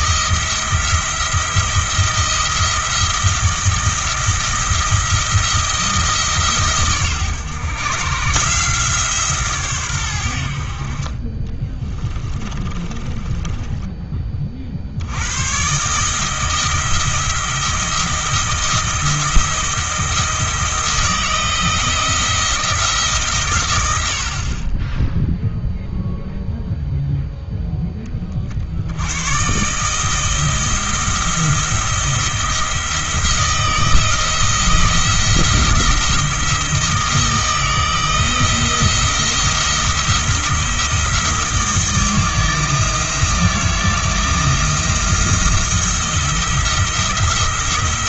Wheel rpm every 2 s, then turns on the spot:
170, 170, 170, 140, 160, 50, 20, 60, 160, 160, 170, 160, 20, 0, 70, 170, 170, 170, 160, 160, 170, 170, 170, 170.
12-14